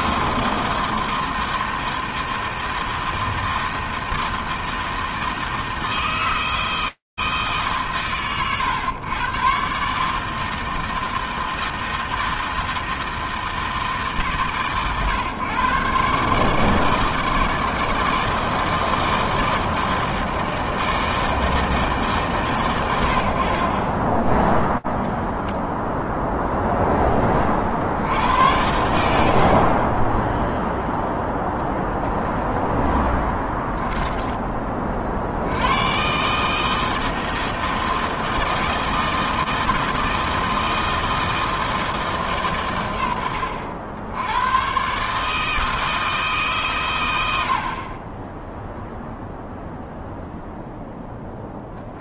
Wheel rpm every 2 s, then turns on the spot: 160, 160, 160, 160, 100, 160, 160, 120, 150, 160, 160, 120, 0, 0, 90, 0, 0, 20, 150, 160, 160, 120, 100, 150, 10, 0.
none